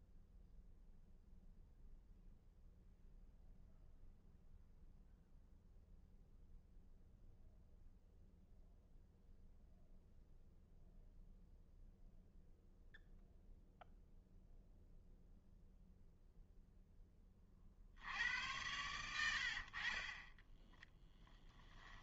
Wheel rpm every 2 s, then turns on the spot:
0, 0, 0, 0, 0, 0, 0, 0, 20, 110, 10.
20-22